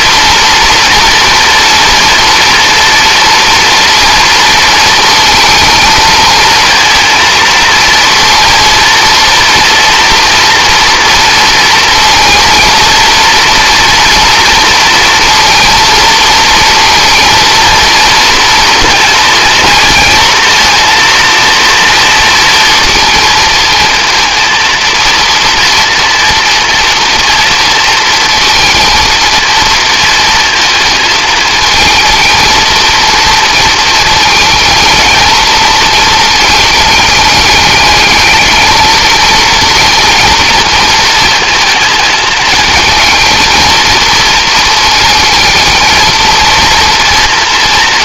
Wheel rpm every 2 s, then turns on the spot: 230, 230, 230, 230, 230, 230, 230, 230, 230, 230, 230, 220, 230, 230, 220, 230, 230, 220, 210, 220, 230, 220, 220, 230.
none